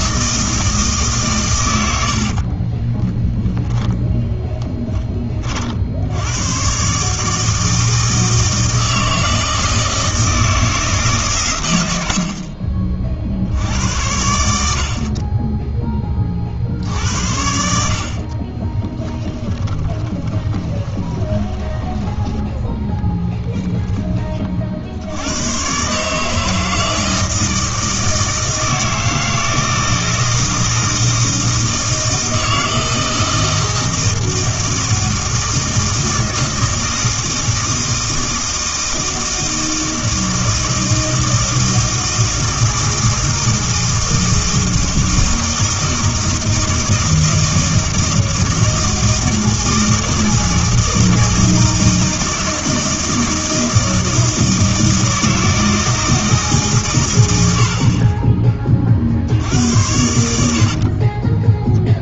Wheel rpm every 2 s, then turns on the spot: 160, 30, 10, 120, 160, 160, 50, 70, 60, 20, 20, 10, 50, 160, 160, 160, 160, 160, 160, 160, 160, 160, 160, 160, 160, 160, 160, 160, 150, 30, 60.
2-4 18-22 60-62